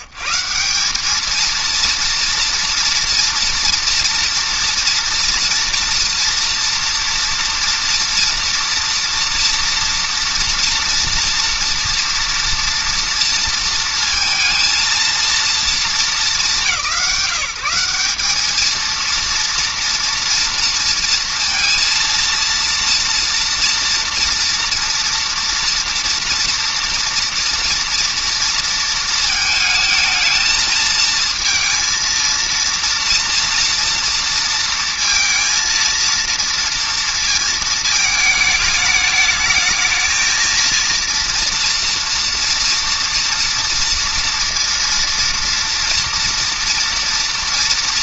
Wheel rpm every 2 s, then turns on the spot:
130, 230, 240, 230, 230, 240, 230, 230, 200, 200, 230, 230, 230, 240, 230, 220, 230, 230, 230, 220, 220, 230, 230, 240.
none